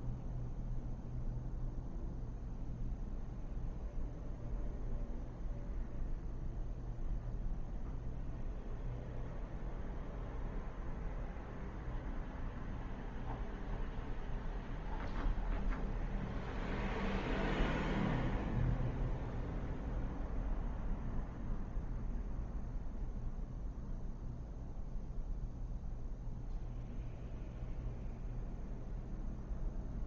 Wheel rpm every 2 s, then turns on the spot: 0, 0, 0, 0, 0, 0, 0, 0, 0, 0, 0, 0, 0, 0, 0.
none